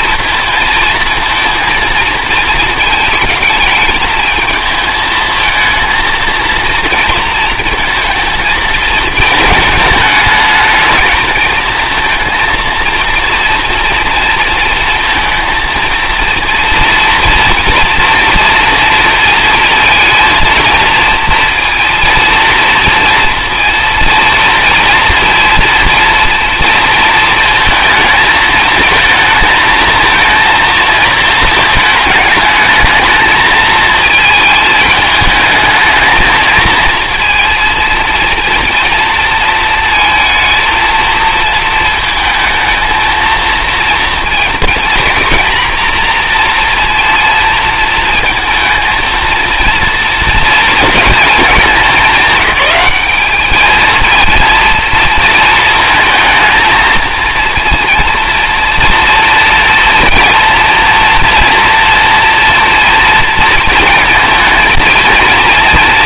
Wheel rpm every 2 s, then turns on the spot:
230, 220, 220, 230, 220, 220, 230, 230, 230, 230, 230, 230, 230, 230, 220, 220, 210, 220, 230, 230, 220, 230, 240, 230, 220, 230, 200, 230, 220, 230, 230, 230, 230.
none